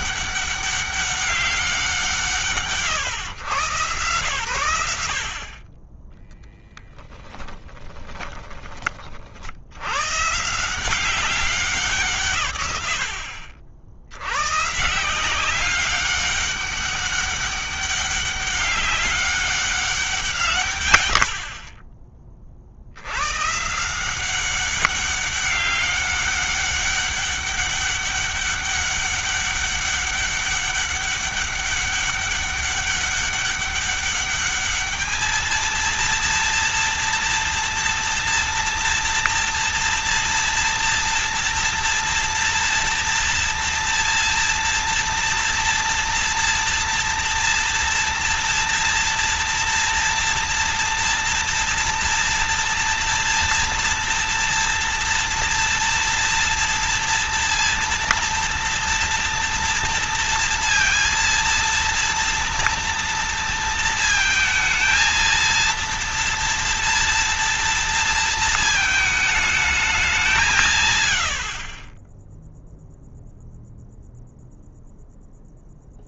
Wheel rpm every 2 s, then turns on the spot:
200, 150, 100, 10, 20, 160, 120, 120, 200, 200, 150, 60, 190, 200, 200, 200, 200, 210, 230, 230, 230, 240, 230, 230, 230, 230, 230, 230, 230, 230, 230, 230, 220, 230, 220, 160, 0, 0.
6-8